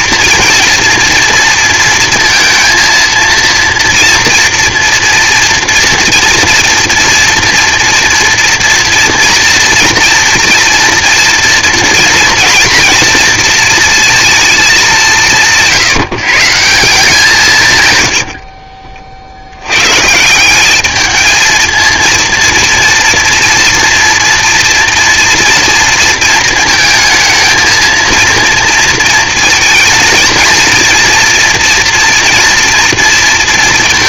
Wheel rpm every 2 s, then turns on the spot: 230, 230, 240, 230, 230, 230, 230, 210, 160, 40, 200, 230, 230, 220, 230, 230, 230.
18-20